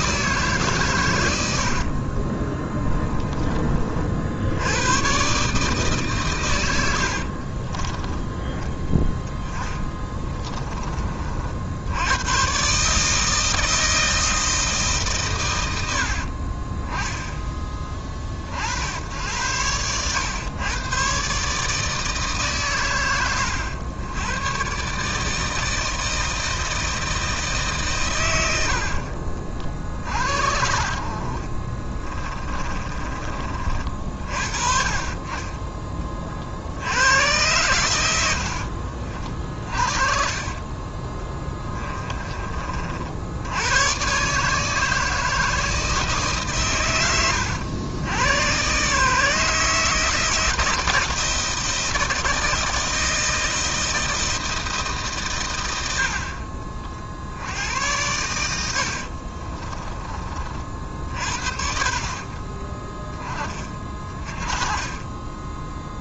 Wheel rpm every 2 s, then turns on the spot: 130, 20, 80, 90, 10, 20, 130, 160, 40, 50, 110, 130, 130, 160, 80, 50, 20, 40, 60, 70, 40, 50, 150, 130, 120, 160, 160, 160, 50, 80, 40, 30, 20.
2-4 8-10 16-18 32-34 38-40 58-60 62-64